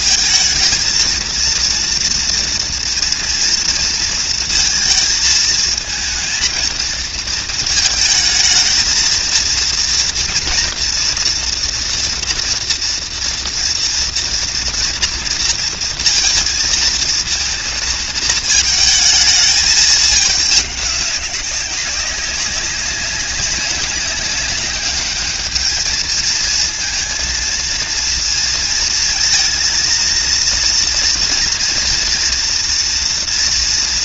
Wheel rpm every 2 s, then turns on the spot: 230, 230, 230, 220, 230, 230, 230, 230, 230, 230, 210, 200, 200, 220, 230, 230, 240.
none